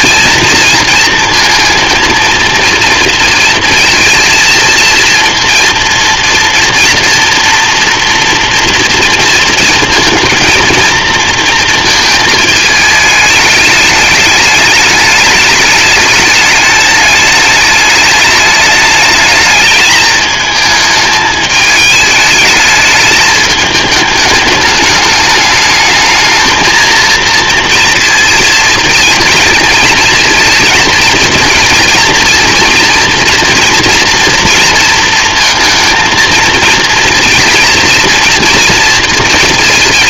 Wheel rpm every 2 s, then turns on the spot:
230, 230, 230, 230, 230, 230, 220, 210, 210, 210, 210, 210, 210, 220, 230, 230, 230, 230, 230, 230.
none